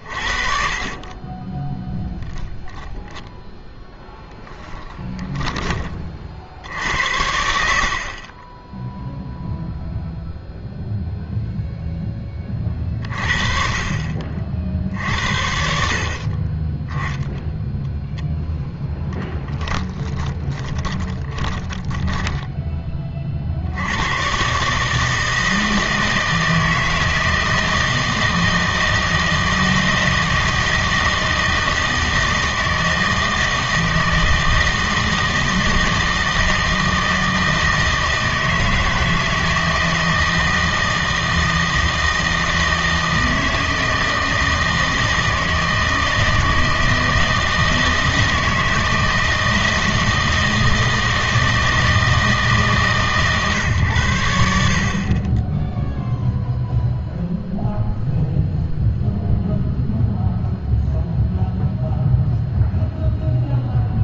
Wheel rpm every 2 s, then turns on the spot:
40, 20, 10, 70, 10, 0, 30, 50, 10, 10, 20, 10, 140, 160, 160, 160, 160, 160, 160, 160, 160, 160, 160, 160, 160, 160, 150, 60, 0, 0, 0, 0.
0-2 4-6 20-24